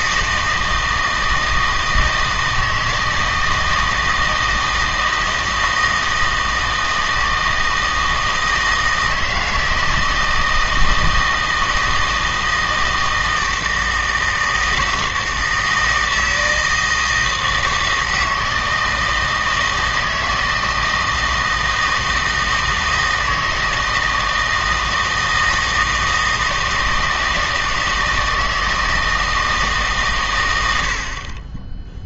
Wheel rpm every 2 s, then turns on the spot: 160, 160, 160, 160, 160, 160, 160, 160, 160, 160, 160, 160, 160, 160, 160, 90.
none